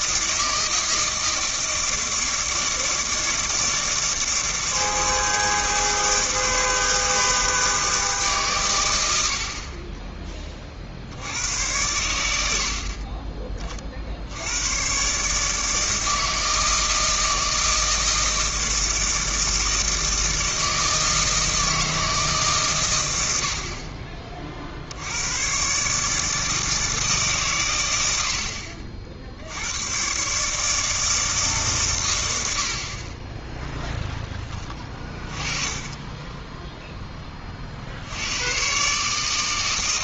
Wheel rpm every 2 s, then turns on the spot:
160, 160, 160, 160, 110, 50, 50, 120, 160, 160, 160, 120, 70, 160, 50, 160, 60, 20, 10, 140.
none